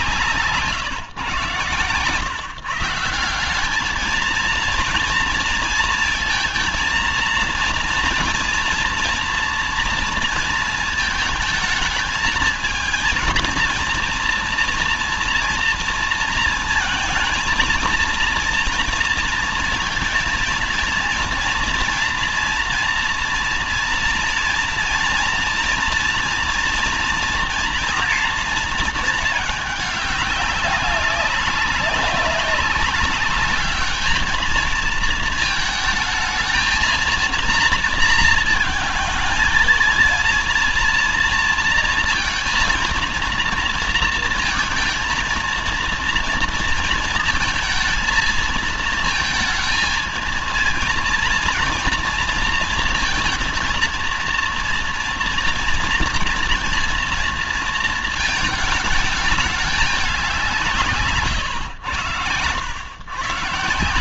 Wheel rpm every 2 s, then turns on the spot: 130, 160, 230, 230, 230, 220, 230, 230, 230, 230, 230, 230, 230, 230, 220, 200, 190, 220, 230, 230, 230, 230, 230, 230, 220, 230, 230, 230, 230, 220, 140, 120.
none